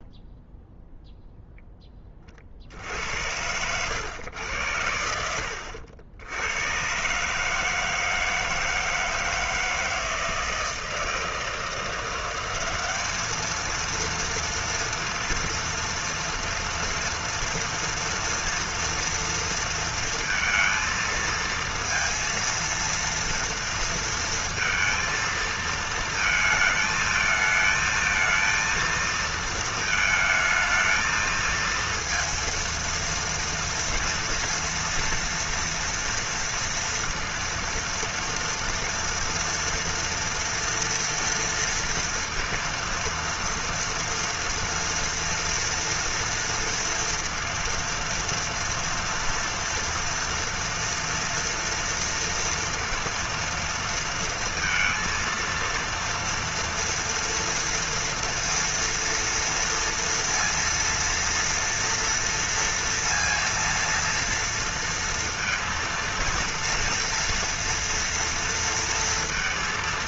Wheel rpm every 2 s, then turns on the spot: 0, 70, 90, 120, 160, 160, 200, 230, 230, 230, 230, 230, 230, 220, 230, 220, 230, 230, 230, 240, 240, 230, 230, 230, 230, 240, 230, 230, 230, 230, 230, 230, 230, 230, 230.
none